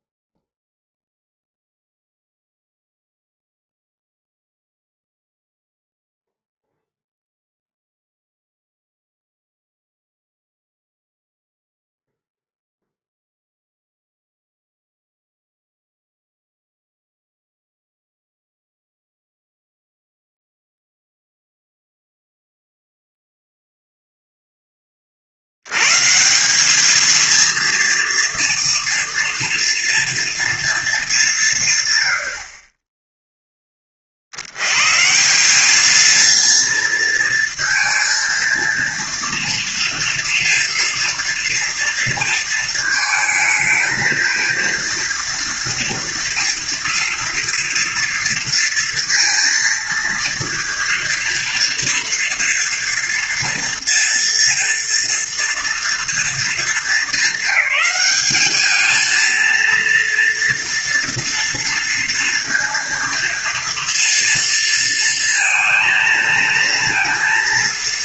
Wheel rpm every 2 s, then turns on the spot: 0, 0, 0, 0, 0, 0, 0, 0, 0, 0, 0, 0, 10, 190, 230, 230, 40, 90, 230, 230, 240, 220, 230, 230, 230, 230, 230, 230, 230, 220, 230, 230, 230, 230.
none